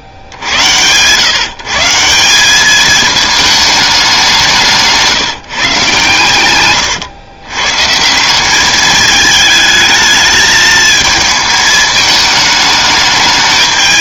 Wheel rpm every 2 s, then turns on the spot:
60, 200, 180, 120, 200, 220, 210.
none